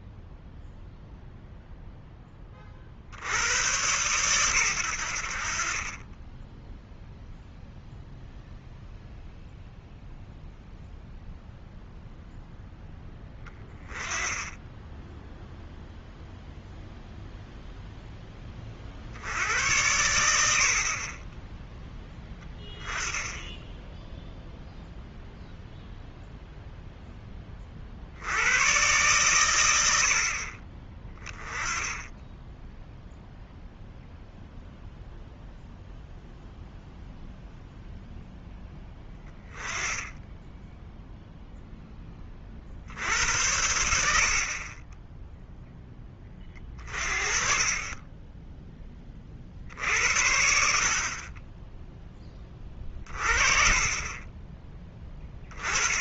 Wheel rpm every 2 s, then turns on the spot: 0, 40, 90, 0, 0, 0, 10, 10, 0, 50, 40, 10, 0, 0, 100, 40, 0, 0, 0, 10, 0, 60, 10, 40, 10, 60, 30, 20.
none